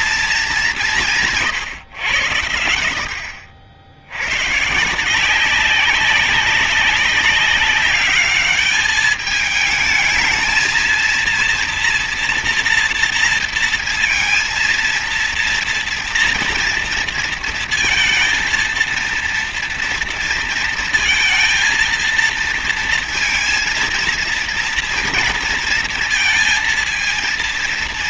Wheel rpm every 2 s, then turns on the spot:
210, 100, 110, 190, 210, 230, 230, 230, 230, 230, 230, 230, 230, 230.
none